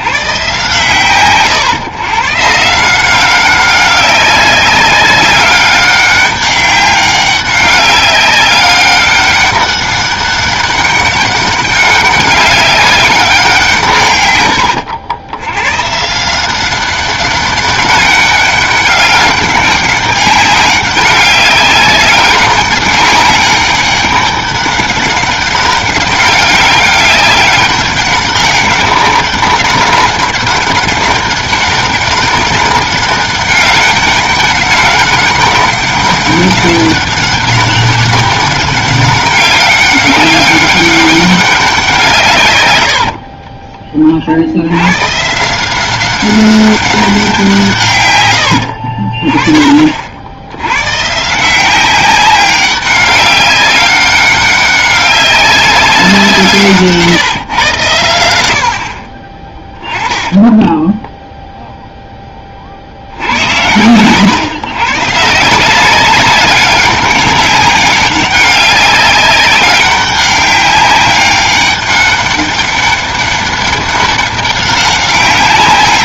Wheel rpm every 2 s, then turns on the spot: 130, 170, 190, 200, 200, 200, 200, 100, 190, 200, 200, 200, 200, 200, 200, 200, 200, 200, 200, 200, 200, 60, 110, 190, 50, 130, 200, 200, 150, 50, 10, 70, 140, 200, 200, 200, 200, 200.
60-62